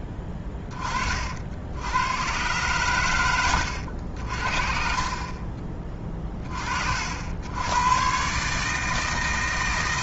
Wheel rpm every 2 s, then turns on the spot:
30, 100, 50, 50, 150.
none